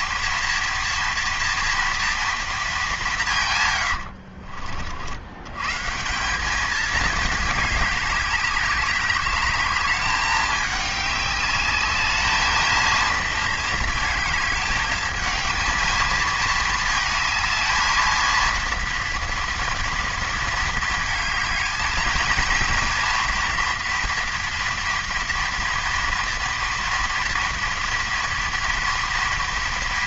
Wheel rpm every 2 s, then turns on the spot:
230, 160, 90, 220, 200, 200, 220, 220, 220, 230, 220, 230, 230, 230, 230.
none